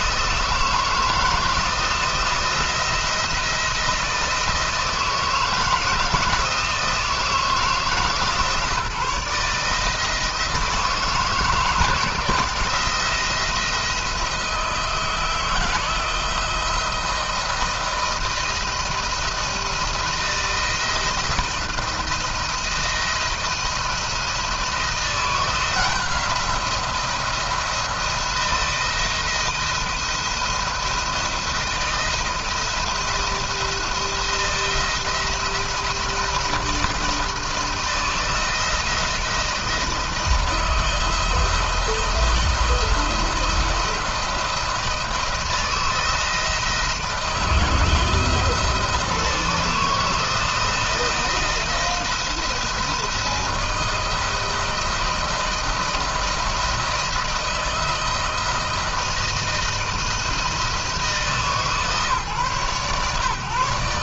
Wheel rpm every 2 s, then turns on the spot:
160, 170, 160, 160, 160, 160, 170, 160, 160, 170, 160, 160, 170, 170, 160, 170, 170, 170, 170, 170, 170, 170, 160, 160, 160, 170, 170, 160, 160, 170, 160, 130.
none